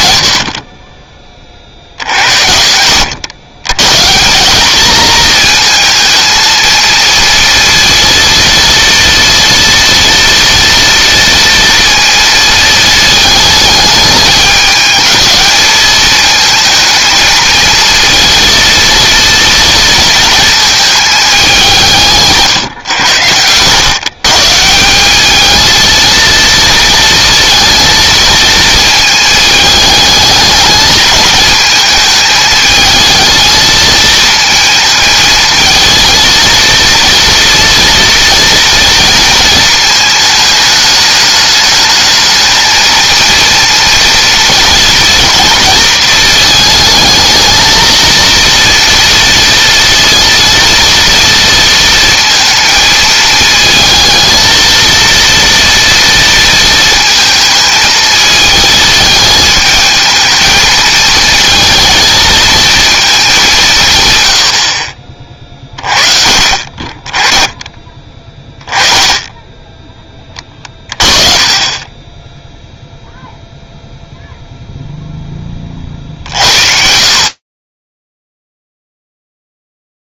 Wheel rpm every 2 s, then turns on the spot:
90, 70, 200, 230, 230, 230, 230, 220, 220, 230, 220, 130, 160, 230, 220, 210, 220, 220, 230, 230, 210, 220, 230, 220, 230, 230, 230, 230, 220, 220, 220, 220, 60, 30, 10, 30, 0, 0, 60, 0.
2-4 70-72